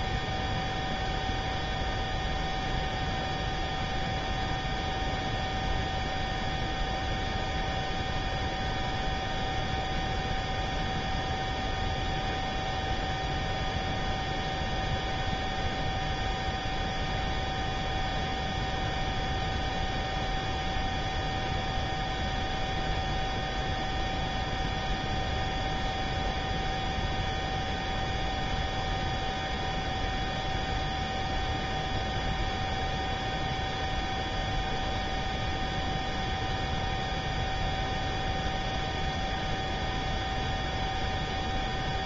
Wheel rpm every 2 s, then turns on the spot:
0, 0, 0, 0, 0, 0, 0, 0, 0, 0, 0, 0, 0, 0, 0, 0, 0, 0, 0, 0, 0.
none